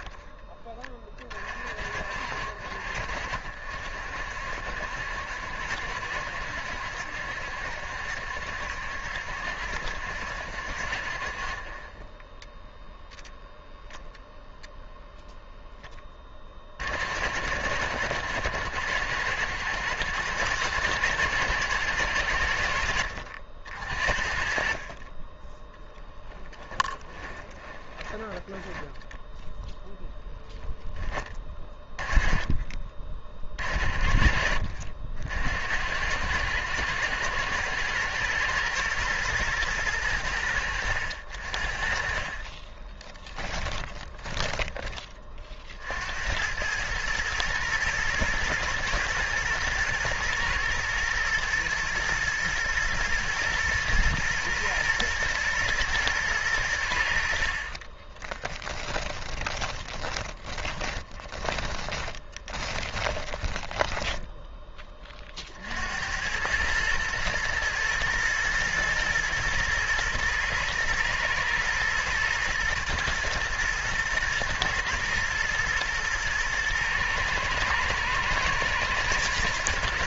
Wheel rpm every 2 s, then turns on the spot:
20, 50, 60, 70, 70, 60, 10, 0, 40, 80, 110, 80, 40, 10, 20, 0, 20, 60, 90, 110, 90, 30, 30, 100, 110, 120, 110, 120, 90, 10, 10, 20, 10, 110, 110, 110, 110, 110, 110, 110.
26-30 42-44 58-64